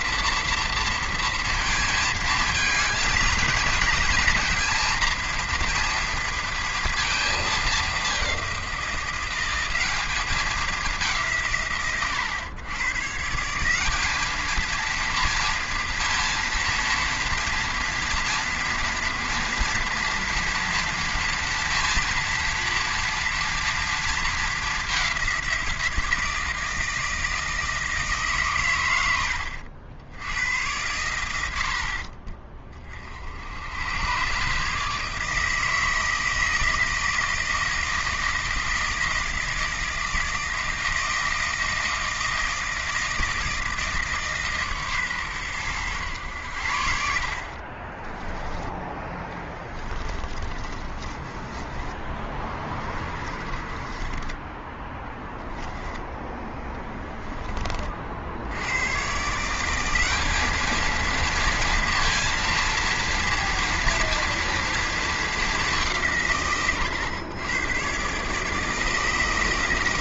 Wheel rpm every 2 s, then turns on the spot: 230, 230, 230, 230, 190, 210, 120, 230, 240, 240, 230, 230, 210, 160, 140, 100, 30, 150, 160, 160, 160, 160, 150, 90, 10, 30, 20, 10, 10, 80, 210, 230, 230, 120, 160.
50-56